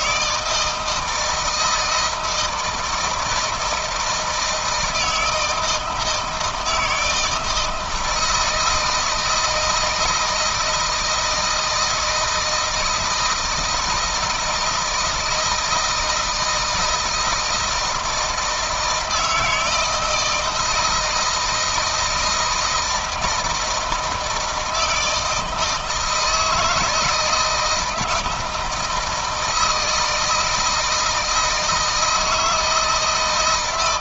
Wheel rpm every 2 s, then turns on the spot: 160, 160, 160, 160, 160, 160, 160, 160, 160, 160, 170, 160, 160, 160, 160, 160, 160.
none